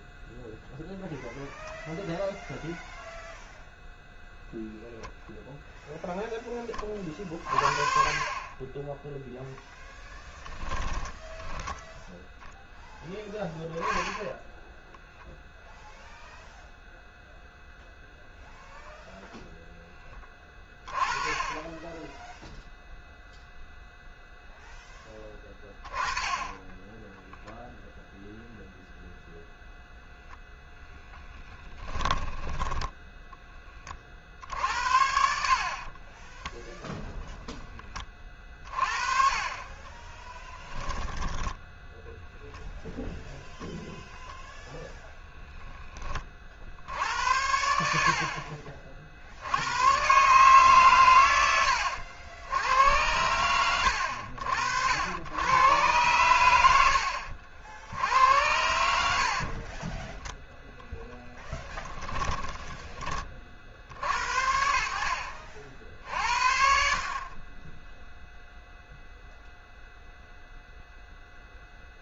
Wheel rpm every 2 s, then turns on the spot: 0, 0, 0, 20, 10, 10, 10, 0, 0, 0, 20, 0, 10, 10, 0, 10, 20, 70, 0, 40, 10, 0, 0, 50, 30, 130, 100, 80, 80, 70, 0, 20, 60, 50, 0, 0.
10-12 30-34 40-42